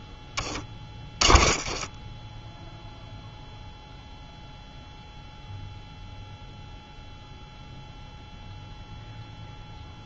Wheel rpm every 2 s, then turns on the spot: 20, 0, 0, 0, 0.
0-2